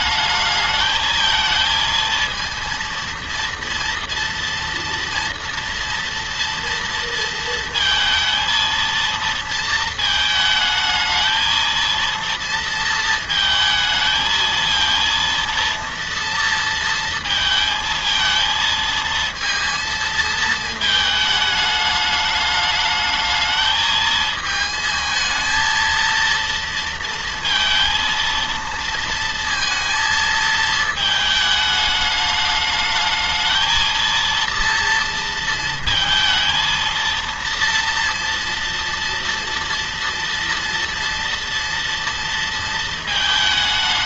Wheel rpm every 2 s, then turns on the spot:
210, 230, 230, 230, 230, 220, 230, 230, 230, 220, 220, 210, 220, 230, 230, 230, 210, 230, 220, 230, 230, 230.
none